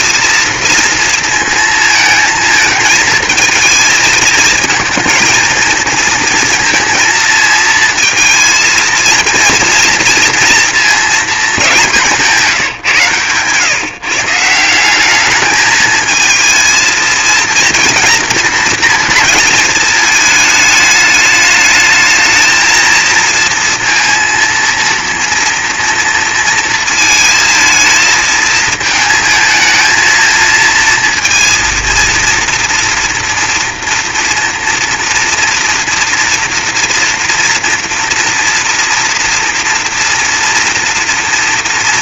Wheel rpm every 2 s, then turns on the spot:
230, 220, 220, 230, 230, 230, 160, 170, 220, 230, 220, 220, 230, 230, 220, 230, 230, 230, 230, 230, 230.
12-14